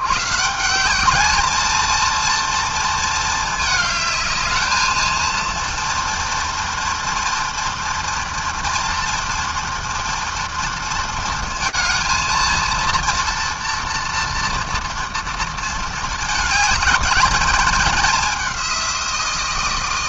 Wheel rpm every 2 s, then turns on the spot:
150, 230, 220, 240, 230, 230, 230, 230, 210, 190.
none